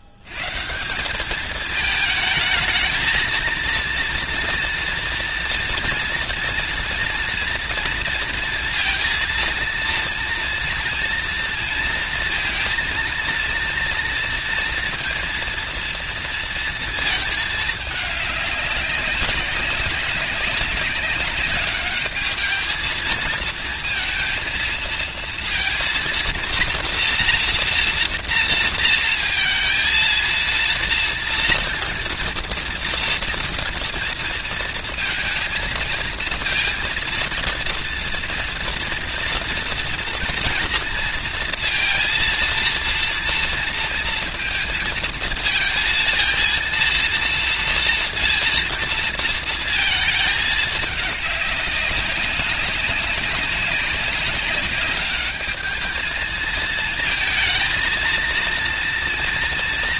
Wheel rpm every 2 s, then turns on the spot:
80, 220, 240, 230, 230, 230, 230, 230, 230, 200, 190, 210, 230, 230, 230, 230, 240, 230, 230, 230, 240, 230, 230, 230, 230, 210, 190, 200, 220, 230.
none